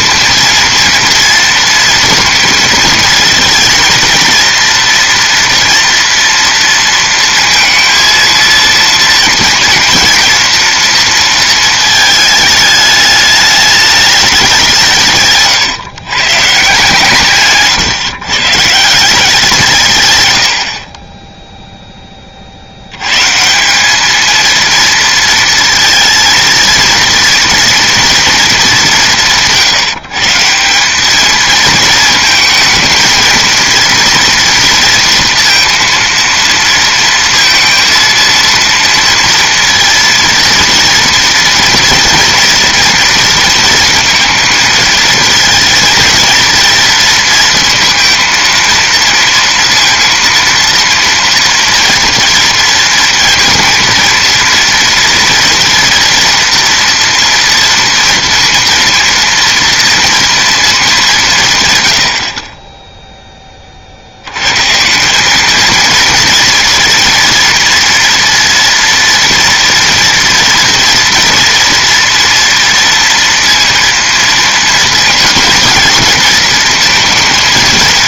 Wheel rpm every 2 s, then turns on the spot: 230, 230, 230, 230, 230, 230, 210, 180, 150, 170, 60, 80, 230, 230, 210, 180, 220, 230, 230, 230, 230, 230, 220, 230, 230, 230, 230, 230, 230, 230, 220, 20, 150, 240, 230, 240, 230, 230, 220.
none